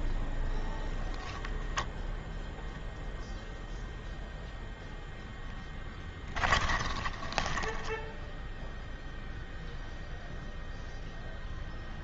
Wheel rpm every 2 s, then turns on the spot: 0, 0, 20, 0, 0, 0.
4-6